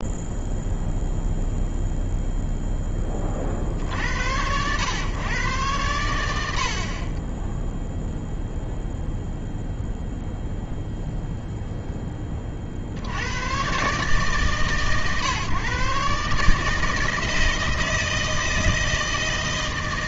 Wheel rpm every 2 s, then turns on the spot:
0, 10, 110, 50, 0, 0, 60, 140, 160, 160.
none